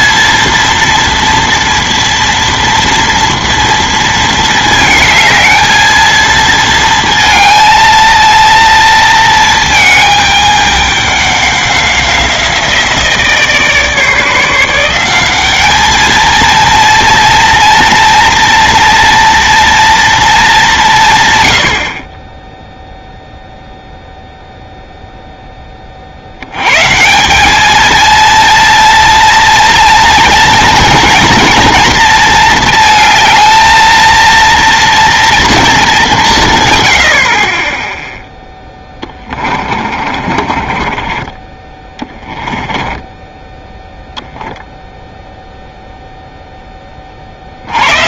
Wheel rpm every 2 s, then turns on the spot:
230, 230, 220, 220, 230, 210, 170, 170, 230, 230, 190, 0, 0, 110, 230, 230, 230, 230, 130, 10, 30, 20, 0, 10.
38-44